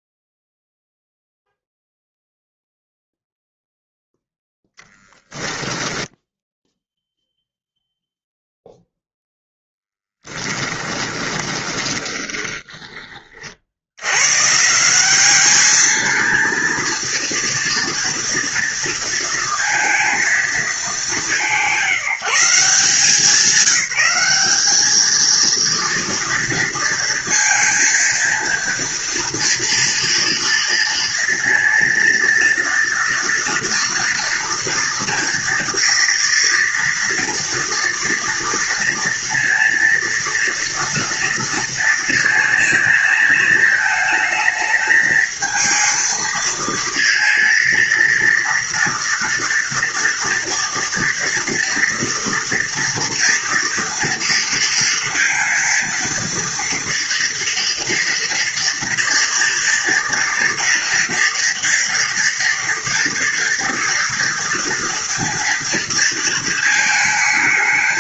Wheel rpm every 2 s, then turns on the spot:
0, 0, 10, 0, 0, 20, 20, 170, 230, 230, 210, 170, 210, 230, 230, 230, 230, 240, 240, 230, 230, 220, 220, 230, 230, 230, 230, 230, 230, 230, 230, 230, 240, 220.
10-12